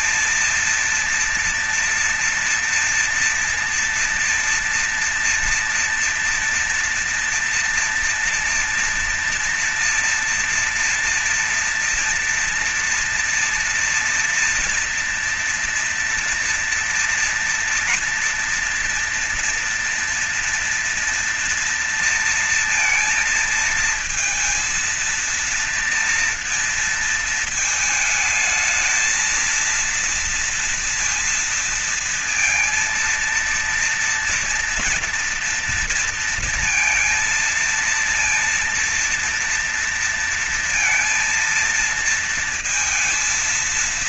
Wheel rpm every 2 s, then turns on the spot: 230, 240, 240, 230, 230, 230, 240, 230, 230, 230, 230, 230, 230, 240, 220, 230, 230, 230, 230, 230, 230, 230.
none